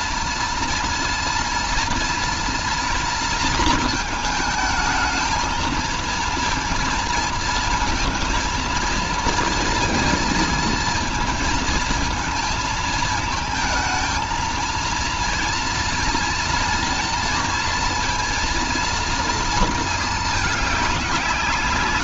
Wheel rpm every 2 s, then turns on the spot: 230, 230, 220, 230, 230, 220, 220, 230, 230, 230, 190.
none